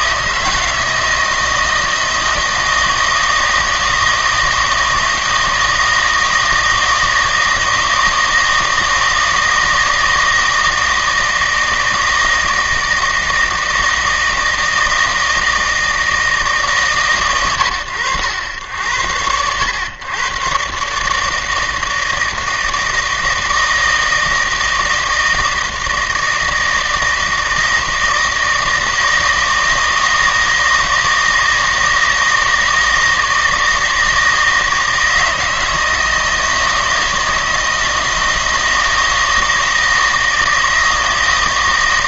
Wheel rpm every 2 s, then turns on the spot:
160, 160, 160, 160, 160, 160, 160, 160, 150, 100, 130, 160, 160, 160, 160, 160, 160, 160, 160, 160, 160.
none